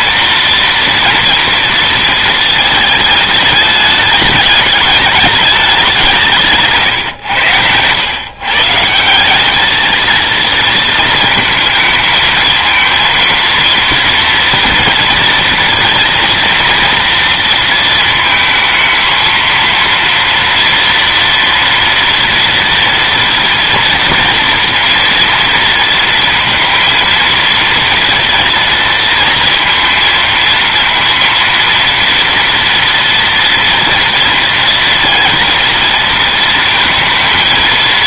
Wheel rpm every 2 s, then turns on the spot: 230, 220, 210, 150, 150, 220, 220, 230, 230, 220, 230, 230, 230, 230, 230, 230, 230, 230, 230.
none